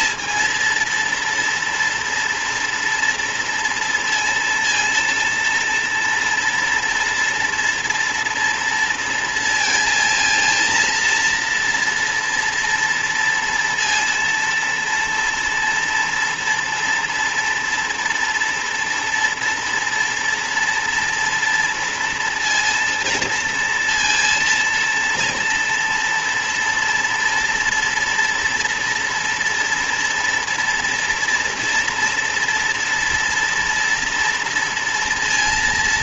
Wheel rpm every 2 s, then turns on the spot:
230, 230, 230, 230, 230, 230, 230, 230, 240, 230, 230, 230, 230, 230, 230, 230, 230, 230.
none